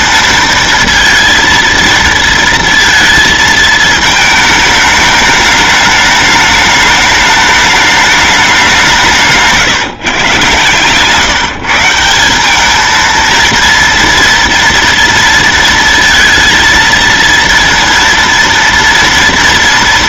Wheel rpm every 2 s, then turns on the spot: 230, 230, 220, 210, 200, 130, 200, 230, 220, 230.
none